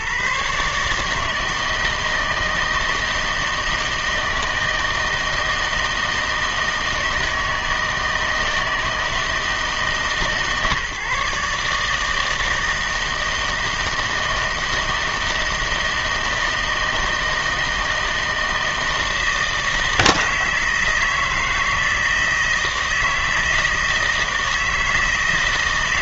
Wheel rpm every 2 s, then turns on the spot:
150, 160, 160, 160, 160, 150, 160, 160, 160, 160, 160, 160, 160.
none